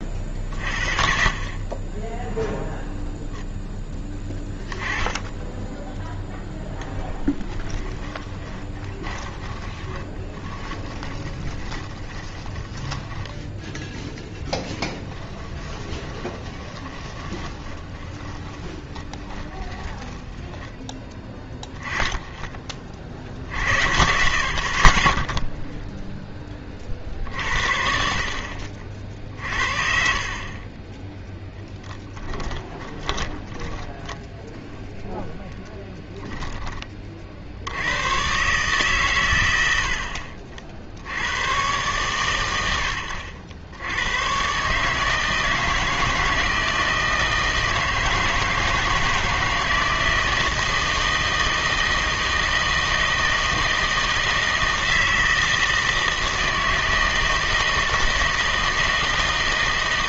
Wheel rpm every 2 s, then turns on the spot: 40, 0, 10, 10, 20, 20, 20, 0, 20, 20, 10, 30, 50, 30, 60, 20, 20, 0, 10, 130, 60, 100, 140, 160, 160, 160, 160, 160, 160, 160.
8-14 16-20 30-34